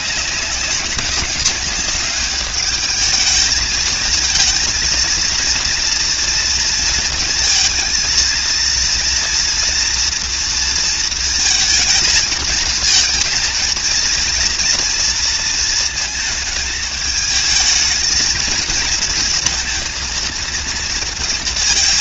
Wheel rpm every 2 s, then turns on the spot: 190, 210, 230, 230, 230, 230, 230, 230, 210, 230, 230.
none